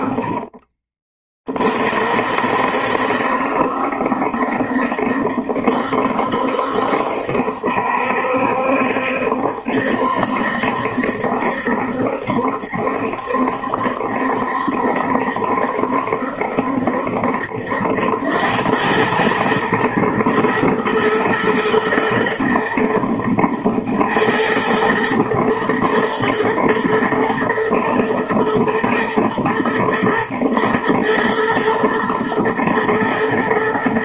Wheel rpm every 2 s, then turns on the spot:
20, 60, 70, 70, 70, 70, 70, 70, 70, 100, 110, 120, 110, 120, 120, 110, 120.
none